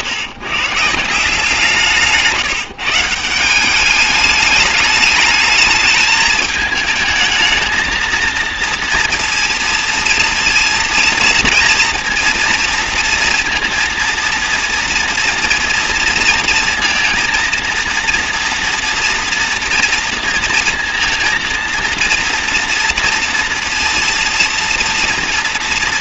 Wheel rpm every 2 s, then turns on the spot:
160, 160, 210, 220, 230, 230, 230, 230, 230, 230, 230, 230, 230.
none